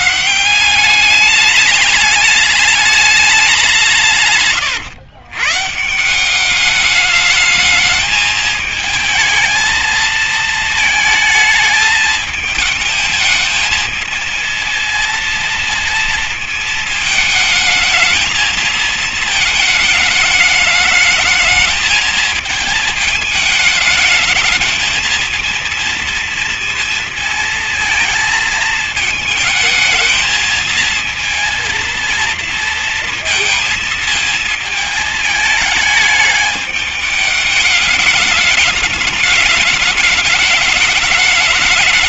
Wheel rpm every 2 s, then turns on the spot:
180, 210, 140, 190, 220, 220, 220, 220, 220, 220, 210, 220, 220, 230, 220, 220, 230, 220, 210, 210, 210.
none